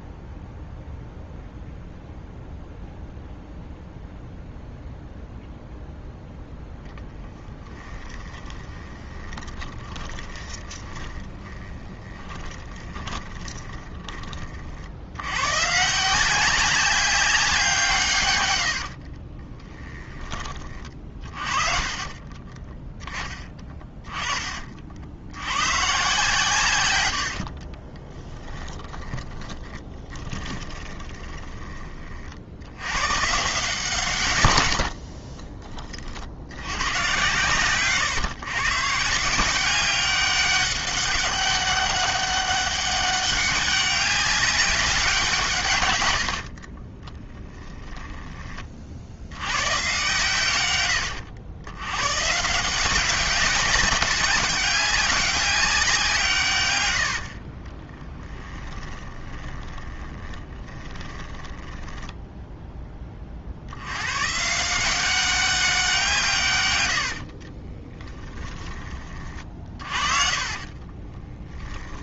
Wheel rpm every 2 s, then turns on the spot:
0, 0, 0, 10, 20, 20, 20, 80, 190, 70, 30, 10, 50, 100, 20, 20, 100, 70, 110, 140, 200, 200, 190, 30, 50, 100, 180, 200, 90, 20, 20, 10, 180, 90, 30, 50.
8-14 18-20 28-32 34-36 46-48 58-62 66-68 70-72